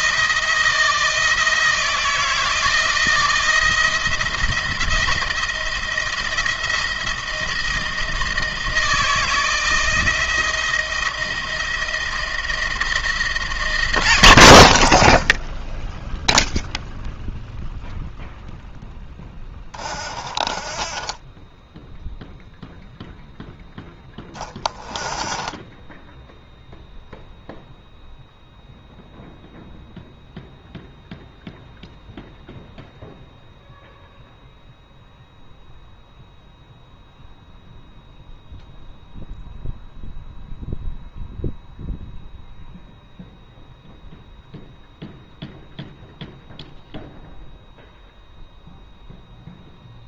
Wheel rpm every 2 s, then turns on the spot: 160, 160, 170, 170, 170, 170, 170, 90, 0, 0, 20, 0, 10, 0, 0, 0, 0, 0, 0, 0, 0, 0, 0, 0, 0.
none